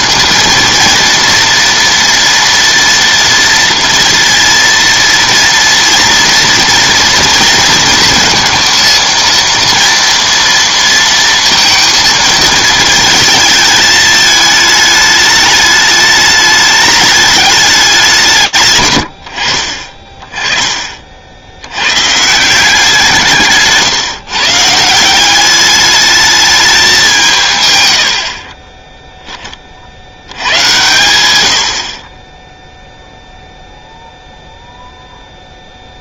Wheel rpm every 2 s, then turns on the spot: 230, 230, 230, 230, 230, 230, 220, 210, 210, 120, 40, 170, 160, 200, 0, 120, 0, 0.
none